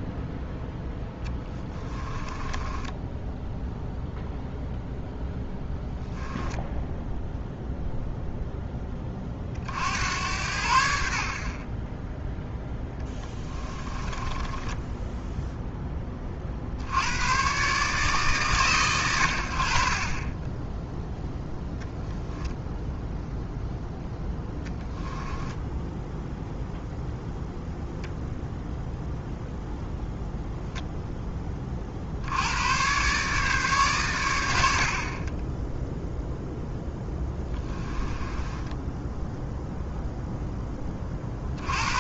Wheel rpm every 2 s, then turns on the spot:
0, 10, 0, 0, 20, 80, 10, 10, 60, 90, 10, 0, 10, 0, 0, 0, 120, 60, 0, 10, 10.
2-4 12-16 24-26 38-40